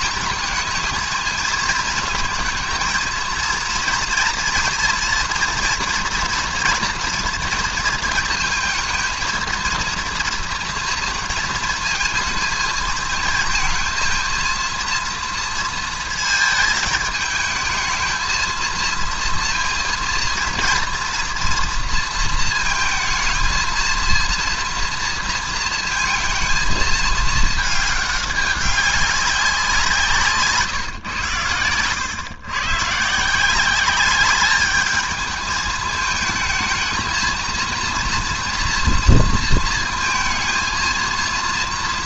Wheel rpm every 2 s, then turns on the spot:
220, 220, 230, 230, 230, 230, 220, 230, 220, 220, 230, 220, 230, 220, 200, 160, 120, 210, 220, 240, 230.
30-32